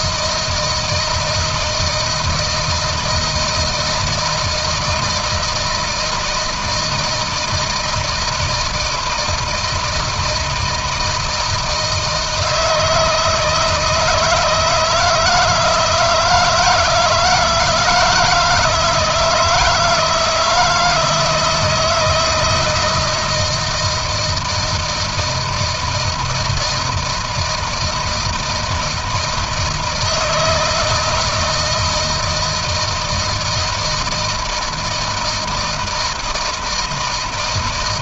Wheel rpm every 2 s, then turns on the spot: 160, 160, 160, 160, 160, 160, 160, 170, 170, 160, 160, 160, 160, 160, 160, 160, 160, 160, 160.
none